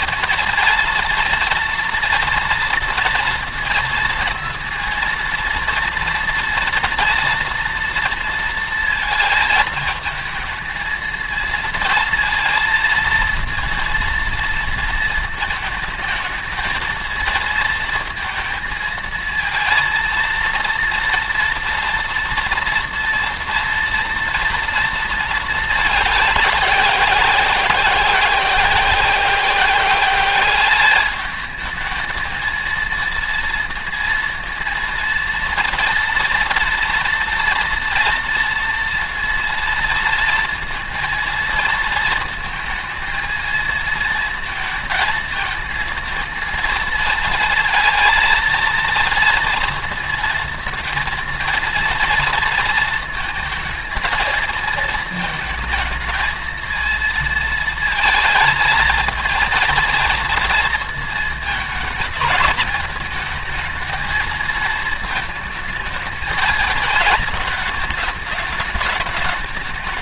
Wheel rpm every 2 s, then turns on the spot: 230, 240, 230, 230, 230, 220, 230, 230, 220, 230, 230, 230, 230, 190, 190, 200, 230, 230, 230, 230, 230, 230, 230, 230, 230, 220, 230, 230, 220, 230, 230, 210, 220, 220, 210.
none